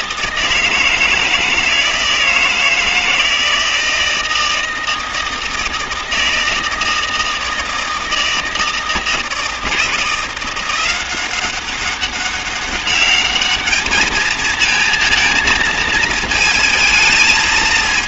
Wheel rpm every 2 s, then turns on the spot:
160, 160, 160, 160, 160, 180, 200, 220, 220.
none